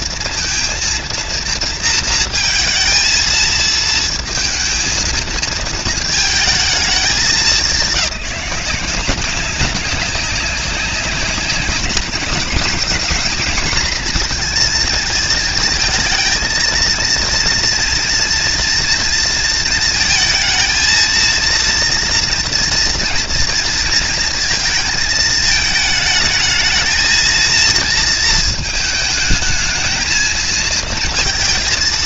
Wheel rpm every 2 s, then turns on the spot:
230, 230, 230, 210, 190, 190, 230, 230, 230, 230, 220, 240, 220, 220, 220, 230.
none